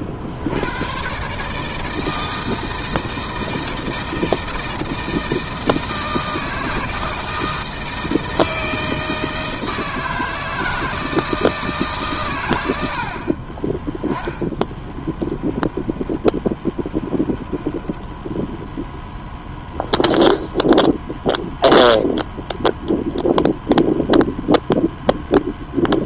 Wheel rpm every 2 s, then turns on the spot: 90, 160, 160, 160, 160, 160, 100, 10, 10, 0, 0, 0, 0.
14-18